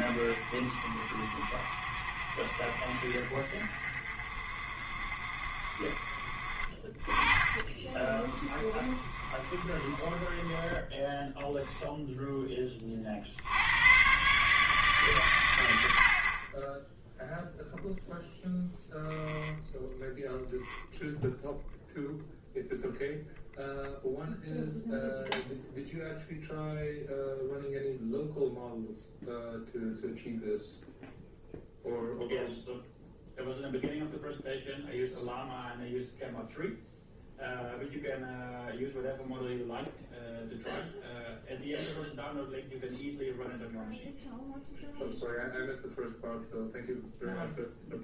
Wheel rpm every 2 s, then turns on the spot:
40, 40, 40, 30, 30, 10, 30, 150, 20, 0, 0, 0, 0, 0, 0, 0, 0, 0, 0, 0, 0, 0, 0, 0.
6-12